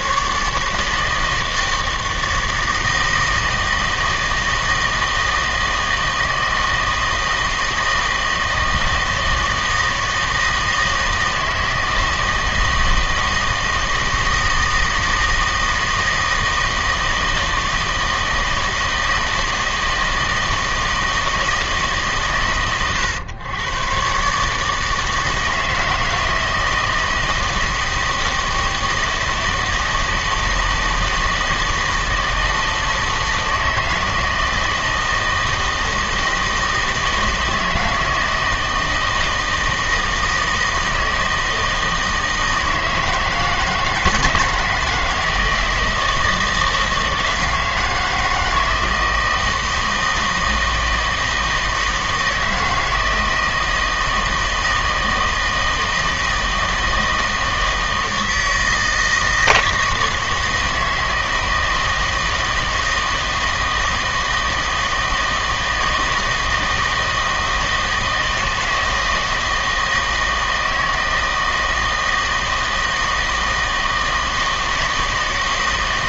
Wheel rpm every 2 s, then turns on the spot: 150, 160, 160, 160, 160, 160, 160, 160, 160, 160, 160, 120, 150, 160, 160, 160, 160, 160, 160, 160, 160, 160, 160, 160, 170, 160, 160, 160, 160, 160, 160, 160, 160, 160, 160, 160, 160, 160.
none